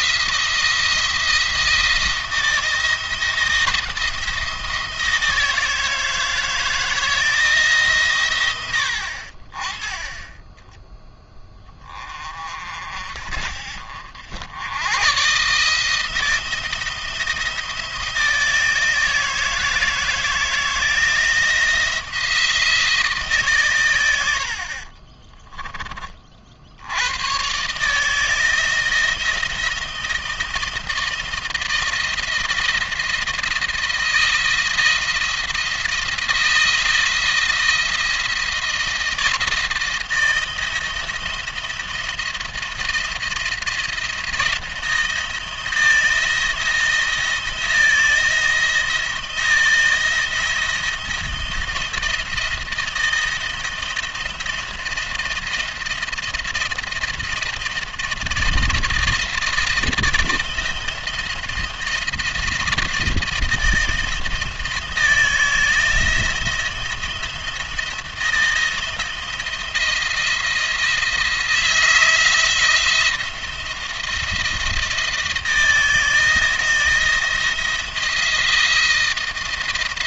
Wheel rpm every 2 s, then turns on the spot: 170, 160, 160, 160, 90, 10, 40, 90, 160, 160, 160, 160, 60, 60, 160, 170, 170, 170, 170, 160, 170, 170, 170, 170, 170, 170, 170, 170, 170, 160, 170, 170, 160, 170, 170, 170, 170, 170, 170, 170.
24-26